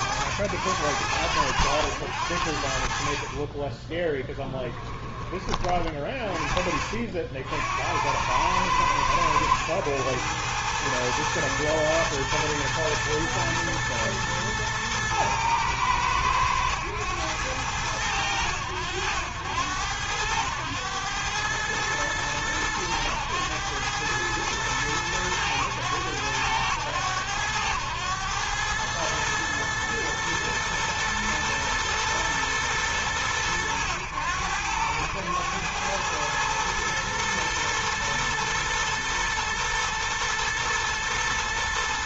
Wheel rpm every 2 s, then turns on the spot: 100, 70, 10, 40, 90, 110, 110, 110, 110, 90, 100, 110, 110, 100, 100, 110, 110, 90, 110, 120, 110.
4-6